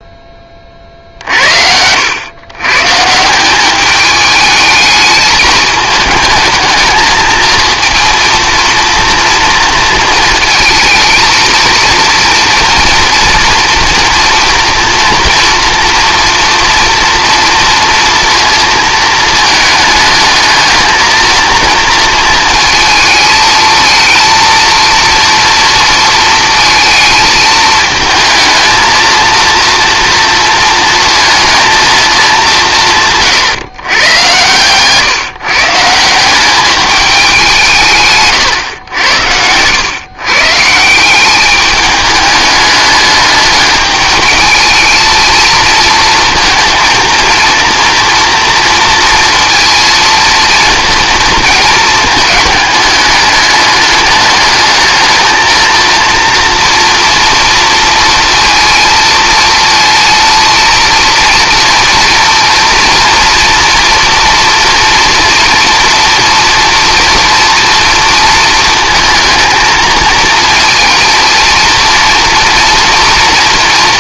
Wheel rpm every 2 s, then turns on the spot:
30, 130, 210, 220, 230, 220, 230, 230, 230, 230, 220, 220, 230, 230, 220, 230, 190, 120, 200, 120, 160, 210, 220, 230, 230, 220, 210, 210, 230, 230, 230, 230, 230, 230, 220, 230, 230.
none